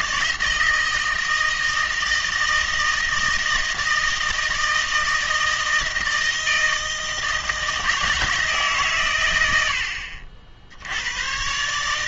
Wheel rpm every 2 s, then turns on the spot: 160, 160, 160, 160, 140, 80.
none